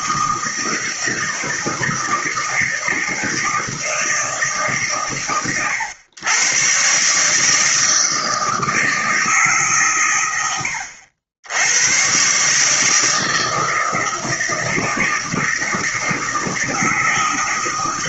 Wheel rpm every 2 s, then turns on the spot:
160, 160, 140, 140, 160, 80, 150, 160, 160.
none